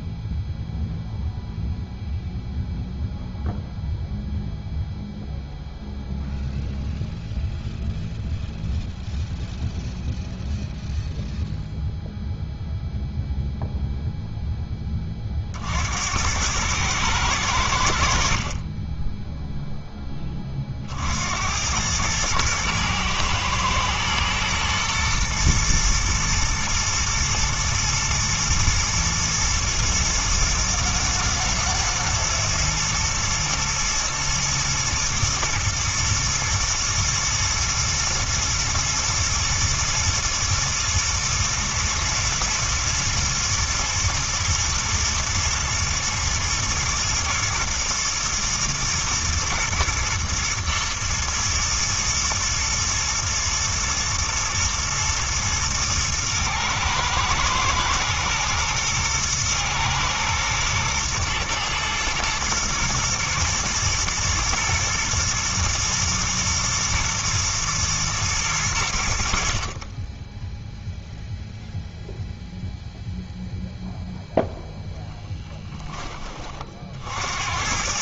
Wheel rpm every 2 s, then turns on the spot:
0, 0, 0, 0, 0, 0, 0, 10, 110, 20, 40, 110, 120, 120, 110, 120, 110, 120, 110, 110, 110, 110, 110, 120, 120, 110, 120, 110, 110, 110, 110, 110, 110, 110, 90, 0, 0, 0, 60.
none